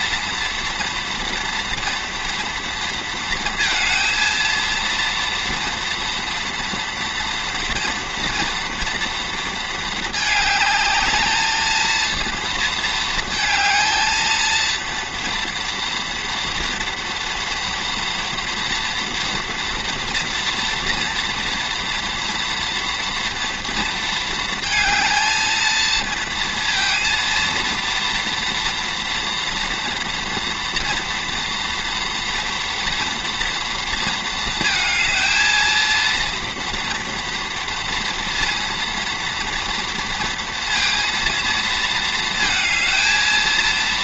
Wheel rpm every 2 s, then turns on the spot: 230, 230, 230, 230, 240, 220, 220, 230, 230, 230, 230, 230, 220, 230, 230, 230, 230, 220, 240, 240, 230, 230.
none